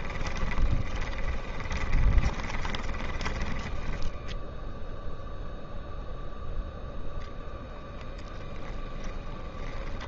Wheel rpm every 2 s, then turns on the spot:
20, 20, 10, 0, 0.
0-6